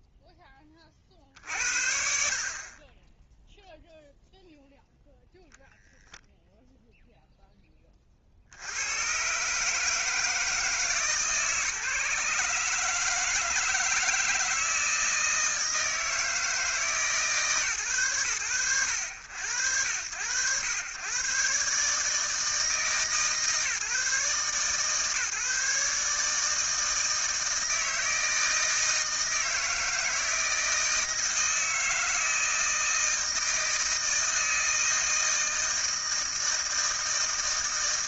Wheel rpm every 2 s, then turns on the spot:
40, 10, 0, 10, 140, 150, 160, 160, 140, 100, 130, 150, 150, 160, 160, 160, 160, 160, 160.
none